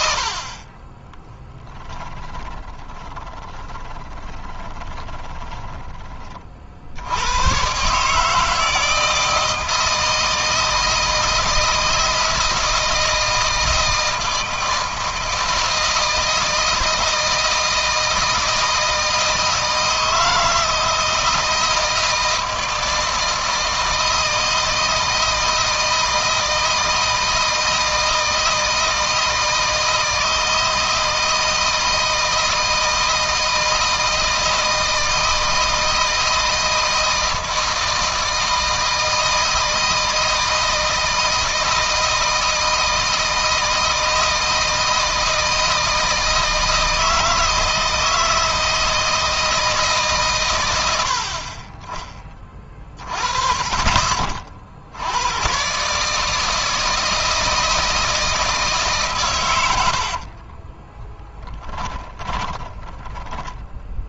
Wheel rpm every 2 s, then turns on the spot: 30, 20, 20, 40, 160, 160, 160, 160, 160, 160, 160, 160, 160, 160, 160, 160, 160, 160, 160, 160, 160, 160, 160, 160, 160, 100, 30, 60, 160, 150, 30, 20.
2-6 60-64